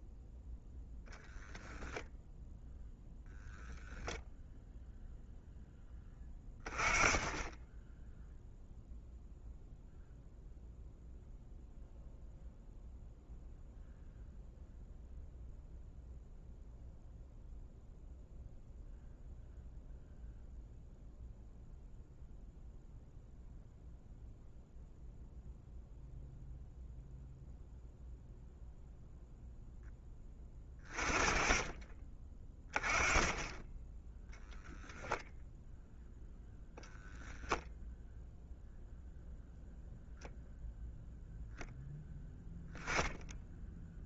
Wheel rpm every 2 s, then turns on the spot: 0, 0, 0, 20, 0, 0, 0, 0, 0, 0, 0, 0, 0, 0, 0, 20, 10, 0, 0, 0, 0, 20.
none